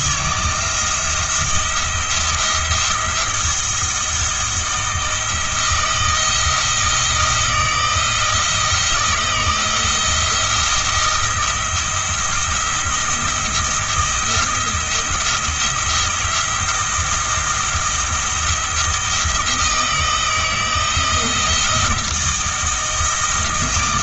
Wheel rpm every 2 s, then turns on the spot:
170, 170, 160, 160, 170, 170, 170, 170, 170, 170, 170, 160.
none